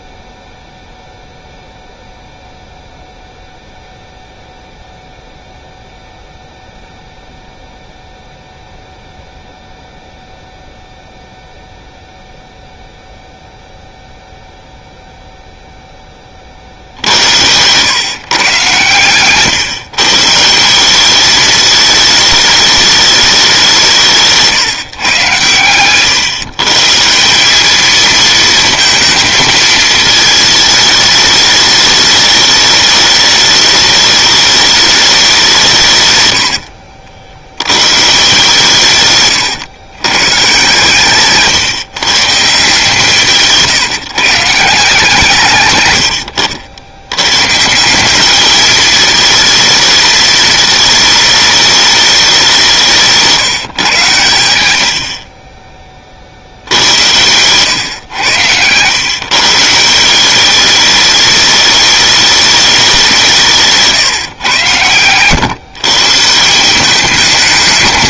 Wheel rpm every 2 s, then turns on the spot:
0, 0, 0, 0, 0, 0, 0, 0, 60, 120, 170, 210, 150, 140, 230, 220, 210, 210, 80, 140, 130, 150, 150, 80, 210, 220, 180, 80, 70, 110, 200, 200, 110, 180.
36-38